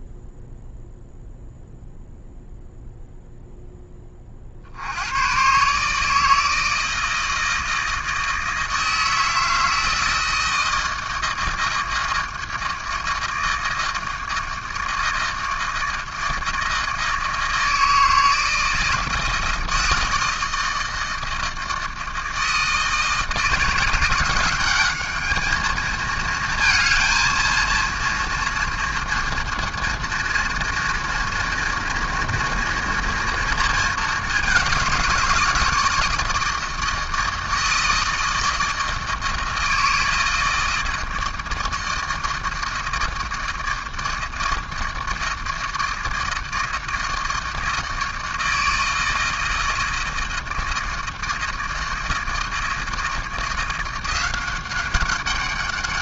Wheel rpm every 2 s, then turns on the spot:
0, 0, 50, 160, 160, 160, 160, 160, 160, 160, 160, 160, 200, 220, 230, 230, 230, 190, 160, 160, 160, 160, 160, 160, 160, 160, 160, 190.
none